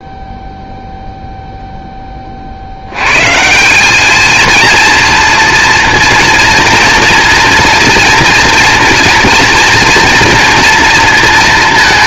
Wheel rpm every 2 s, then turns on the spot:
0, 120, 230, 240, 230, 230.
none